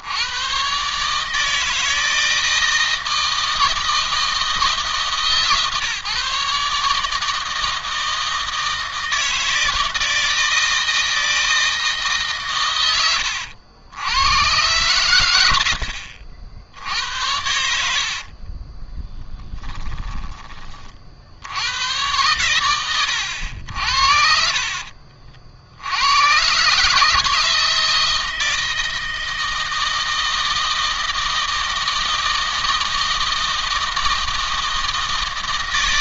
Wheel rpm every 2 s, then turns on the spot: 110, 160, 160, 150, 160, 160, 120, 110, 70, 40, 30, 100, 50, 130, 160, 160, 160, 160.
18-20 24-26